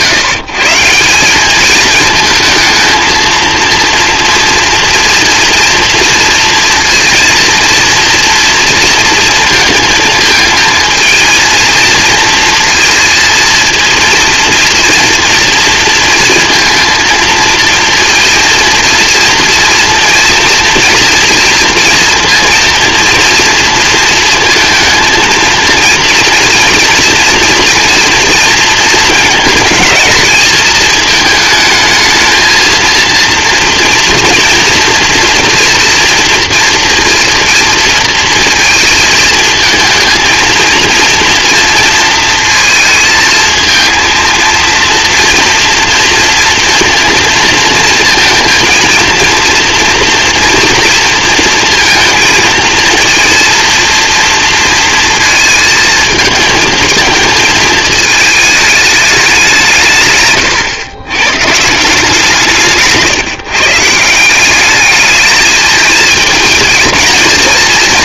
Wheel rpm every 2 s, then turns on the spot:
150, 220, 230, 230, 230, 220, 230, 230, 230, 230, 230, 230, 230, 230, 230, 220, 220, 230, 230, 220, 230, 230, 230, 230, 230, 240, 230, 230, 220, 210, 110, 160, 190, 220.
none